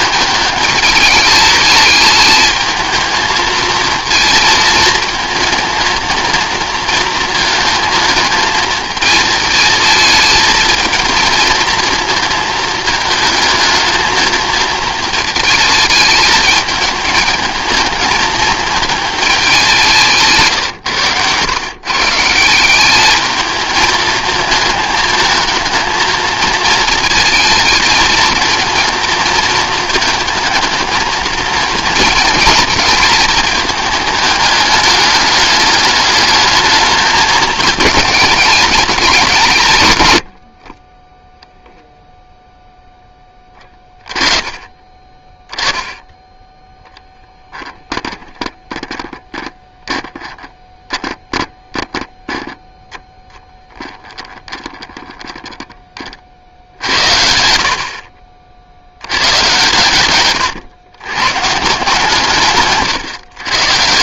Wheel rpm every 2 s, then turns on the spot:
220, 220, 230, 230, 220, 220, 220, 220, 220, 220, 150, 170, 220, 220, 230, 230, 230, 210, 210, 210, 50, 0, 20, 10, 10, 10, 0, 10, 60, 80, 120, 130.
none